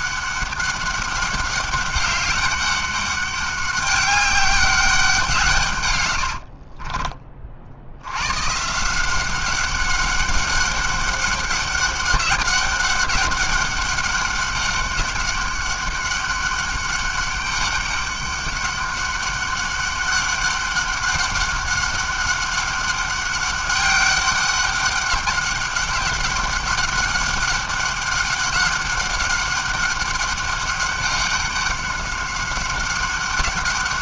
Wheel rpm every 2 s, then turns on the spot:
200, 190, 190, 50, 130, 200, 200, 200, 200, 200, 200, 200, 200, 200, 200, 200, 190.
6-8